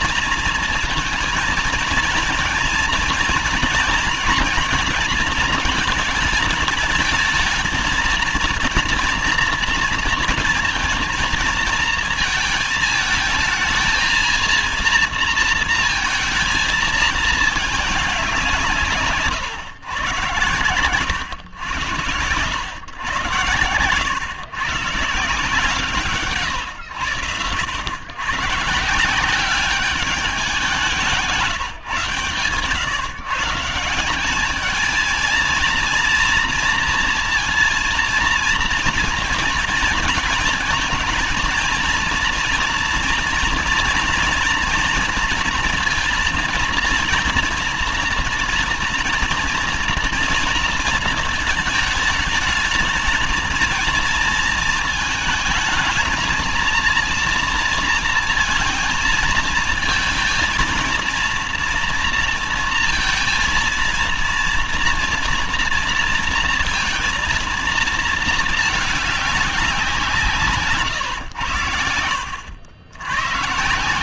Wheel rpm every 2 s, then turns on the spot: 230, 230, 230, 220, 230, 230, 220, 230, 220, 170, 100, 140, 150, 110, 140, 180, 120, 220, 230, 230, 220, 230, 230, 230, 230, 230, 220, 230, 220, 230, 230, 230, 230, 230, 210, 140, 80.
none